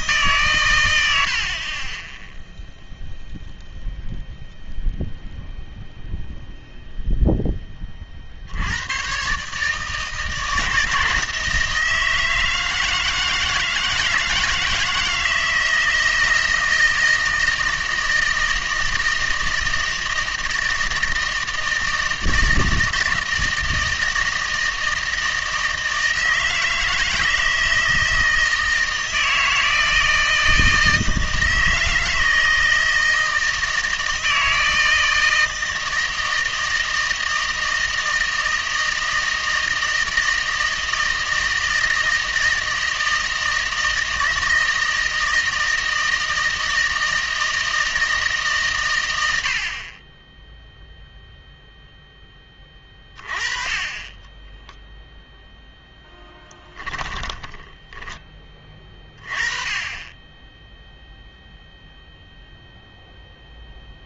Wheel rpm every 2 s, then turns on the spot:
110, 0, 0, 0, 100, 160, 160, 160, 160, 160, 160, 160, 160, 160, 160, 160, 160, 160, 160, 160, 160, 160, 160, 160, 130, 0, 20, 0, 10, 20, 0, 0.
56-58